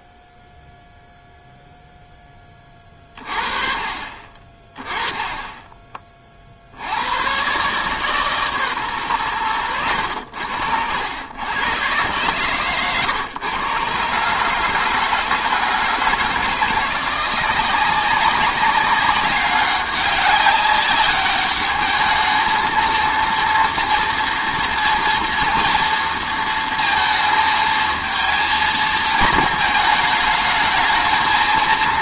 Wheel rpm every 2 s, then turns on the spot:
0, 20, 20, 50, 140, 80, 130, 150, 160, 200, 200, 220, 230, 230, 230, 220.
none